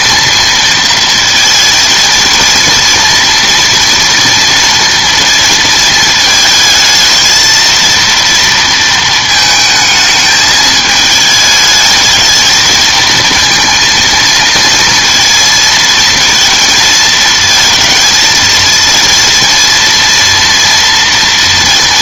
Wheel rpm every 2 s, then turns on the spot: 230, 230, 230, 220, 230, 210, 220, 230, 230, 230, 230.
none